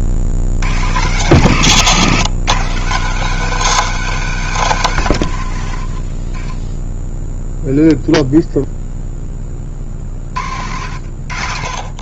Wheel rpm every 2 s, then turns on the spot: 70, 140, 170, 30, 0, 80.
none